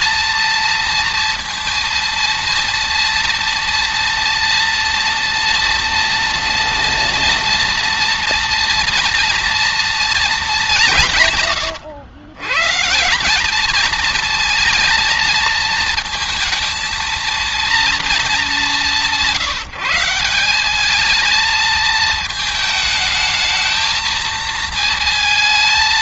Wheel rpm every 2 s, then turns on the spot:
230, 230, 230, 230, 230, 140, 170, 230, 230, 160, 210, 220, 220.
none